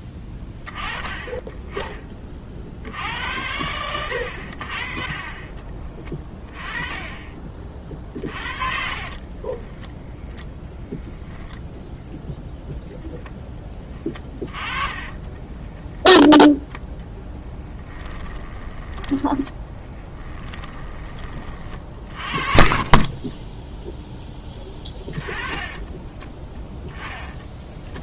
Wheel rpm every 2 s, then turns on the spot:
20, 70, 40, 20, 60, 0, 0, 30, 10, 20, 20, 40, 20, 10.
14-20 22-28